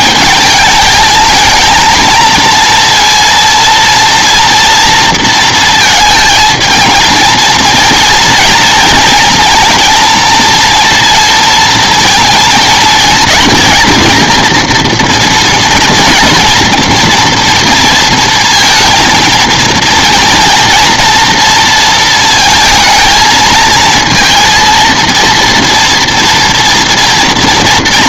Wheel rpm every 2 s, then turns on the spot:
220, 230, 240, 220, 230, 230, 220, 230, 230, 230, 230, 220, 230, 230.
none